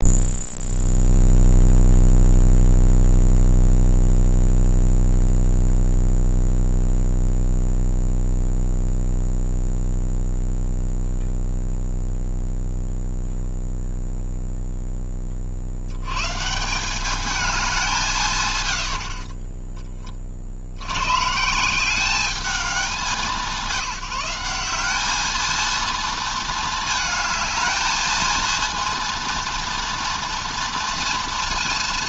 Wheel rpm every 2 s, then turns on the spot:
0, 0, 0, 0, 0, 0, 0, 0, 170, 110, 80, 200, 200, 220, 230, 240.
18-20